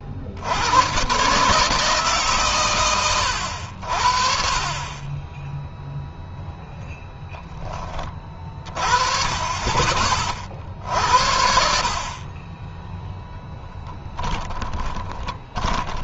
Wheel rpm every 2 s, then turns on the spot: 120, 110, 30, 0, 40, 60, 10, 20.
14-16